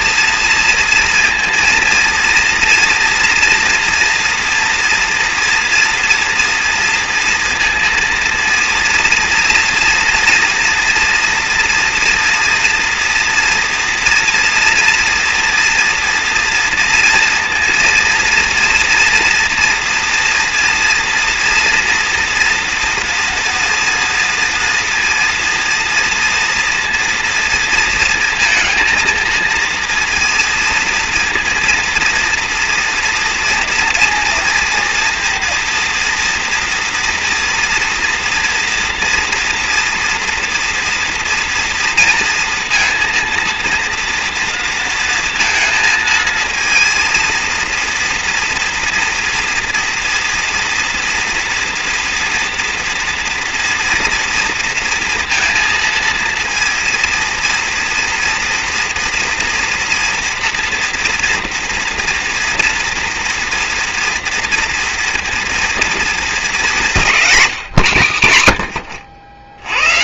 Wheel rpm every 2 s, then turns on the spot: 230, 230, 230, 230, 230, 230, 240, 240, 230, 230, 230, 240, 230, 230, 230, 230, 230, 230, 230, 230, 230, 230, 230, 230, 230, 240, 240, 230, 230, 230, 230, 230, 230, 220, 120.
none